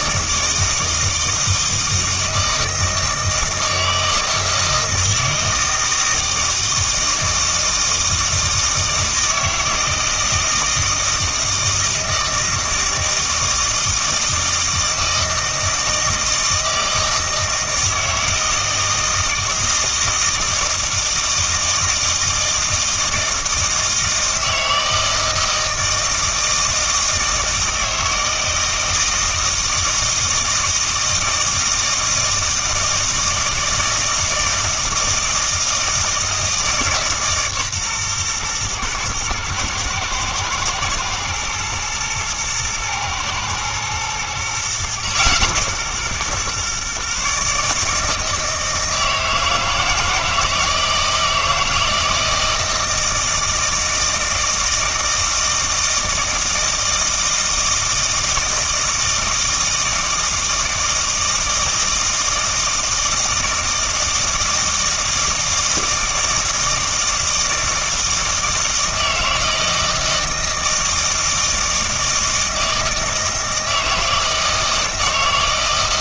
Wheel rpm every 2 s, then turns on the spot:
160, 160, 160, 160, 160, 160, 160, 160, 160, 160, 160, 160, 160, 160, 160, 160, 160, 160, 160, 120, 120, 110, 130, 130, 160, 160, 160, 160, 160, 160, 160, 160, 160, 160, 160, 160, 160, 160.
none